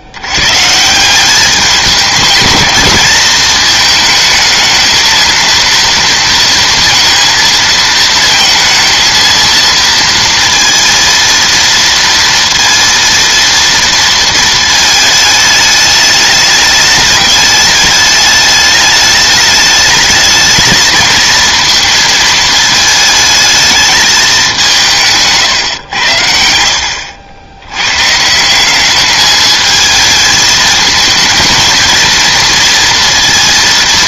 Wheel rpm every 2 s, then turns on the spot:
140, 220, 220, 230, 220, 230, 230, 220, 210, 210, 220, 220, 180, 70, 180, 220, 230.
none